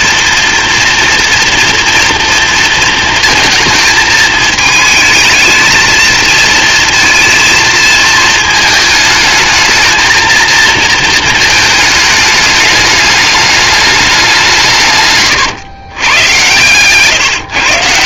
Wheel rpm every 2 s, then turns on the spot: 230, 230, 220, 230, 220, 230, 210, 140, 140.
none